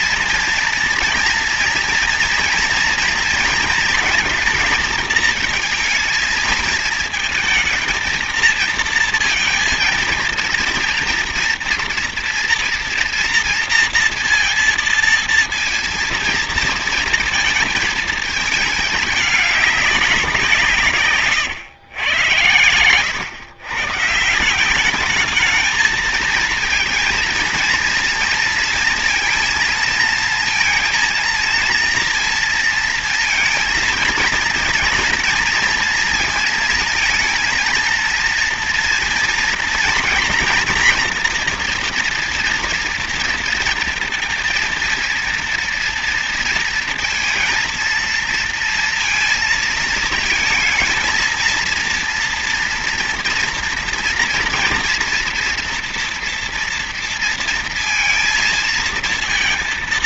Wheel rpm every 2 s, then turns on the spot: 230, 230, 230, 220, 230, 230, 240, 230, 230, 210, 180, 110, 170, 220, 230, 230, 230, 230, 220, 230, 230, 240, 230, 230, 230, 220, 230, 230, 240, 230.
none